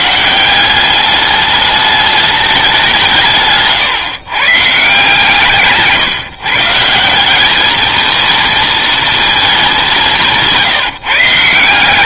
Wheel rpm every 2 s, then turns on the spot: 190, 190, 140, 160, 230, 160.
none